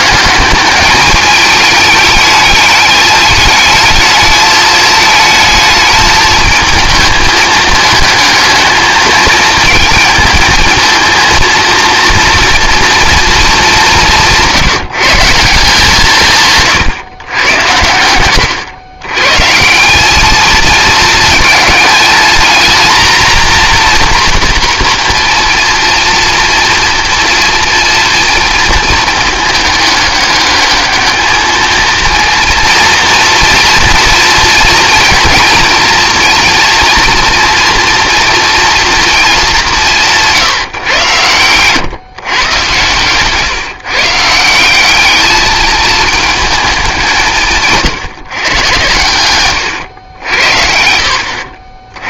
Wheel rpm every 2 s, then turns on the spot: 210, 210, 220, 220, 220, 220, 230, 150, 140, 110, 220, 230, 240, 240, 220, 220, 230, 230, 230, 230, 150, 130, 190, 200, 120, 70.
none